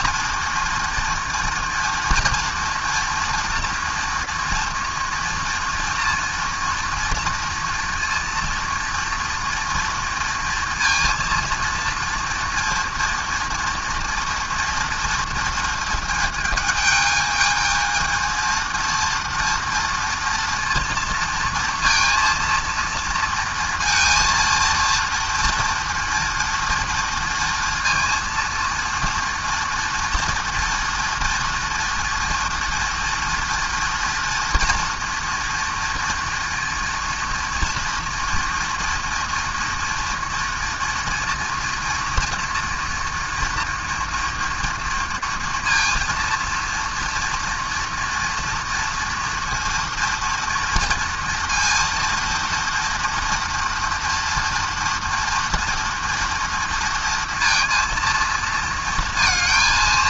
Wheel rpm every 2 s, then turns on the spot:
230, 230, 230, 230, 230, 230, 230, 230, 220, 220, 230, 230, 230, 230, 230, 240, 230, 230, 230, 230, 230, 230, 240, 230, 230, 230, 230, 230, 230, 230.
none